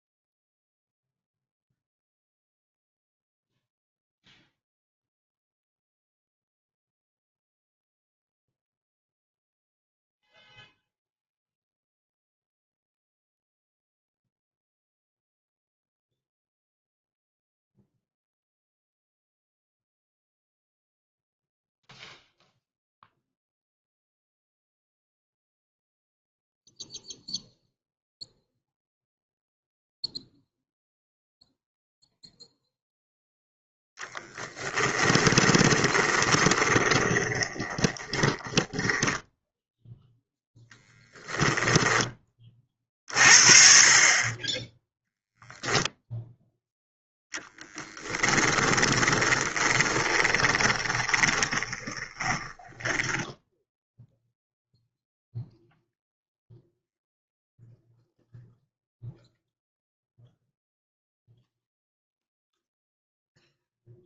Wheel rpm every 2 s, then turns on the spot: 0, 0, 0, 0, 0, 0, 0, 0, 0, 0, 0, 0, 0, 0, 0, 0, 0, 10, 20, 10, 10, 40, 10, 0, 20, 20, 10, 0, 0, 0, 0, 0.
34-42 48-54